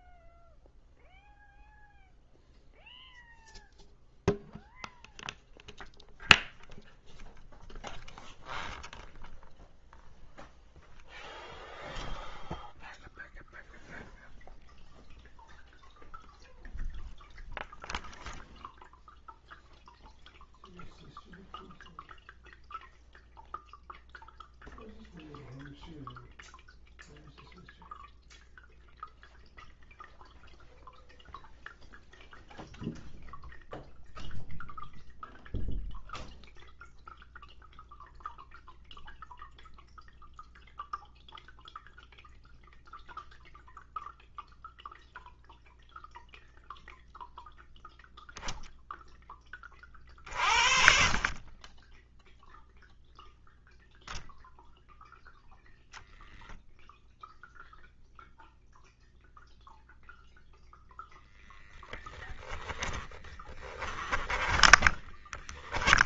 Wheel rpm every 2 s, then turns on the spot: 0, 0, 0, 0, 0, 0, 0, 0, 0, 0, 0, 0, 0, 0, 0, 0, 0, 0, 0, 0, 0, 0, 0, 0, 10, 50, 0, 0, 0, 0, 10, 10, 10.
62-66